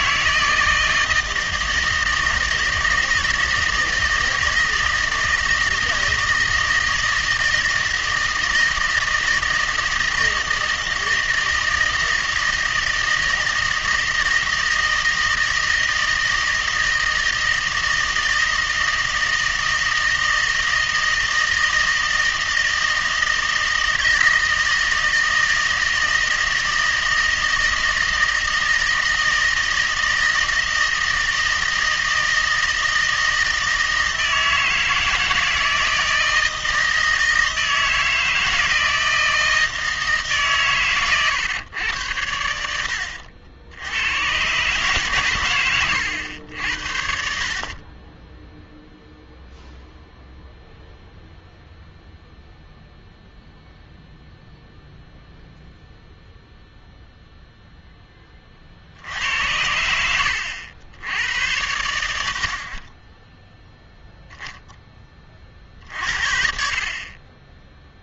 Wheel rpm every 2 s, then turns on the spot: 160, 160, 160, 160, 160, 160, 160, 160, 160, 160, 160, 160, 160, 160, 160, 160, 160, 160, 160, 160, 120, 80, 130, 70, 0, 0, 0, 0, 0, 60, 80, 20, 10, 40.
none